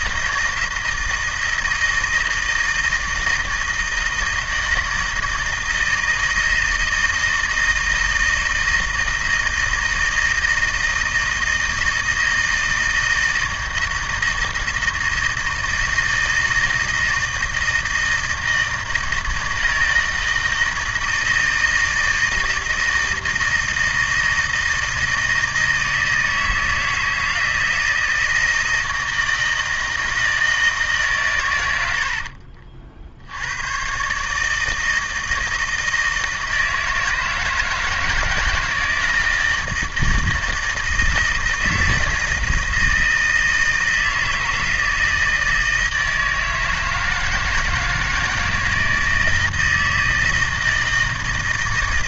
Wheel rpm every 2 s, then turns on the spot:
160, 160, 160, 160, 160, 160, 160, 160, 160, 160, 160, 160, 160, 160, 160, 160, 50, 160, 160, 160, 160, 160, 160, 160, 160, 160.
none